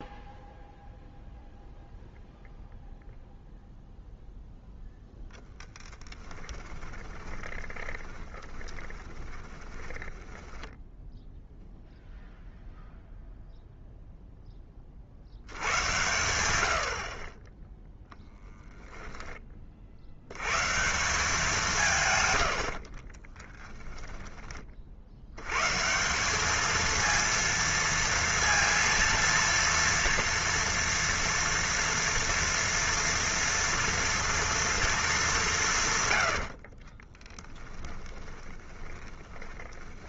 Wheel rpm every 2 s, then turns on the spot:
0, 0, 0, 20, 20, 10, 0, 20, 80, 10, 130, 90, 40, 220, 230, 230, 230, 230, 70, 20.
6-12 18-20 36-40